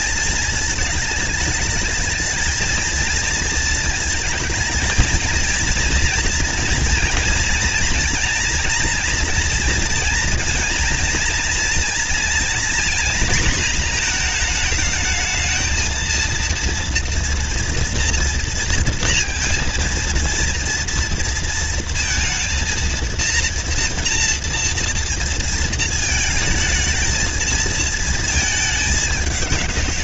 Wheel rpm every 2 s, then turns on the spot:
220, 220, 230, 230, 230, 230, 240, 230, 230, 230, 230, 230, 230, 220, 220.
none